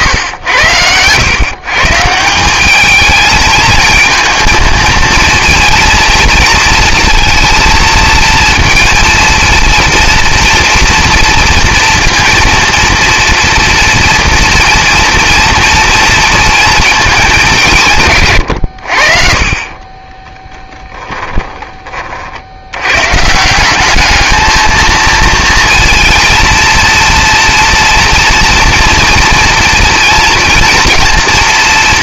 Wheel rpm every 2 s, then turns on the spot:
100, 200, 220, 230, 230, 230, 240, 230, 230, 100, 10, 90, 220, 230, 230, 230.
18-22